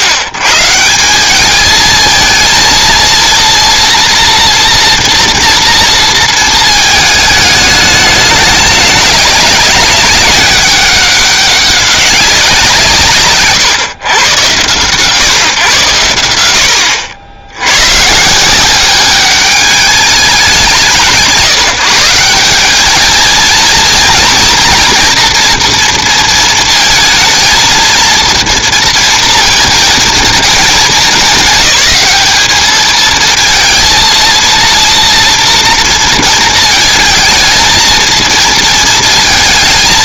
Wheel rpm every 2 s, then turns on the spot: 110, 230, 230, 230, 210, 200, 170, 120, 80, 160, 170, 190, 230, 230, 230, 220, 210, 230, 220, 220.
none